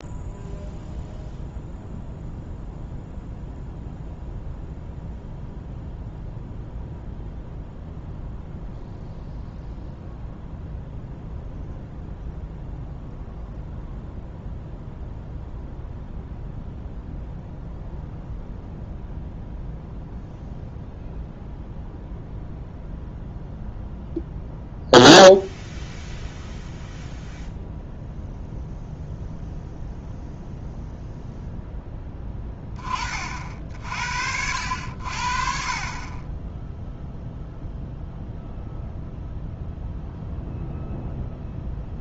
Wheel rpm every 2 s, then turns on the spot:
0, 0, 0, 0, 0, 0, 0, 0, 0, 0, 0, 0, 0, 0, 0, 0, 20, 70, 0, 0, 0.
none